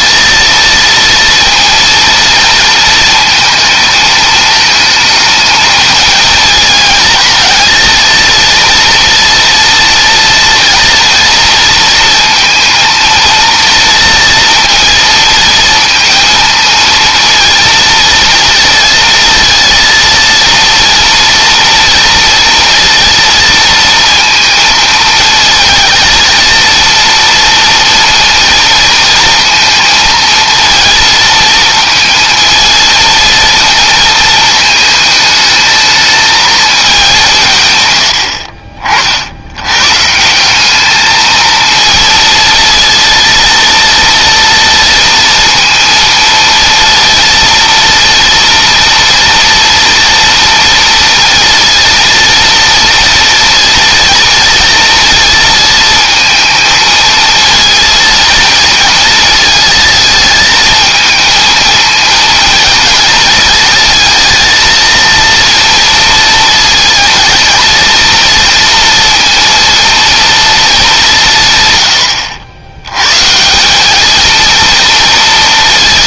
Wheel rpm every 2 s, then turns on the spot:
230, 230, 220, 220, 240, 230, 230, 230, 230, 230, 230, 230, 220, 230, 230, 230, 230, 220, 200, 50, 210, 230, 230, 230, 230, 230, 230, 230, 220, 220, 220, 220, 230, 230, 230, 210, 120, 230.
none